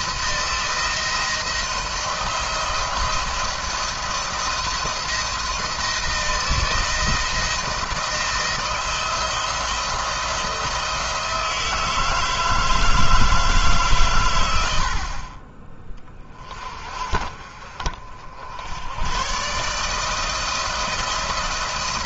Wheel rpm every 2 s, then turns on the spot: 170, 170, 170, 170, 170, 160, 160, 70, 40, 90, 160.
none